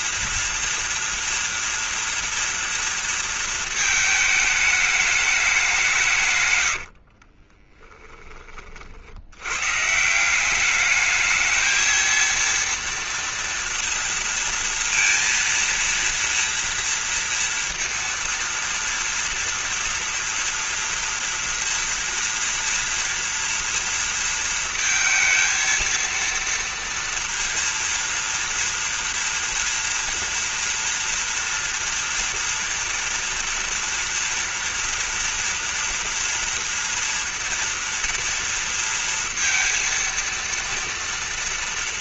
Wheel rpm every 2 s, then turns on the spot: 230, 230, 220, 100, 50, 200, 230, 230, 230, 230, 230, 230, 230, 230, 230, 230, 230, 230, 230, 230, 230.
6-8